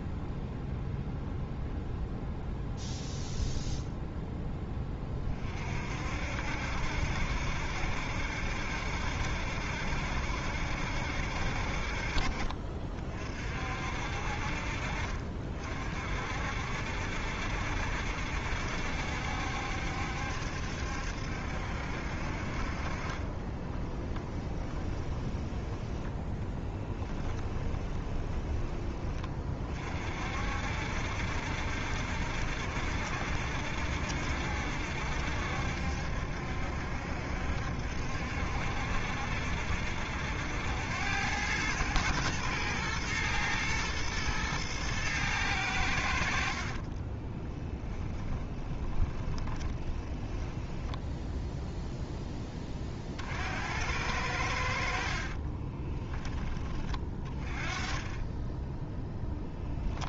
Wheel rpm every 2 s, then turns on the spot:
0, 0, 20, 70, 70, 70, 40, 40, 60, 70, 70, 40, 20, 10, 20, 60, 70, 70, 70, 70, 90, 110, 110, 40, 20, 10, 40, 50, 30, 10.
22-28 46-50 54-56